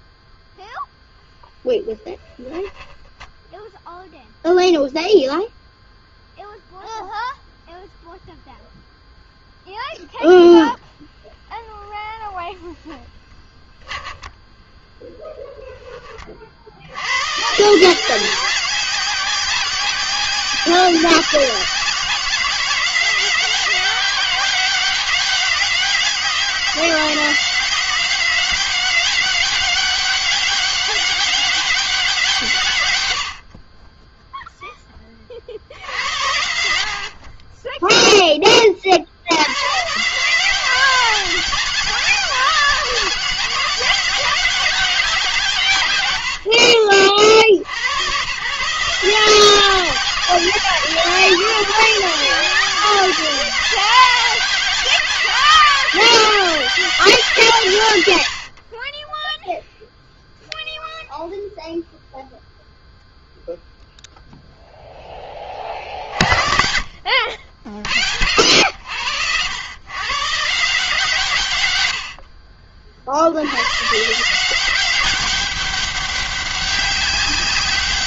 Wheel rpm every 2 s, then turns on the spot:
0, 0, 0, 0, 0, 0, 20, 0, 40, 180, 190, 180, 190, 180, 190, 200, 160, 10, 80, 20, 170, 180, 180, 90, 120, 180, 180, 180, 180, 90, 0, 0, 0, 50, 70, 150, 50, 160, 190.
12-14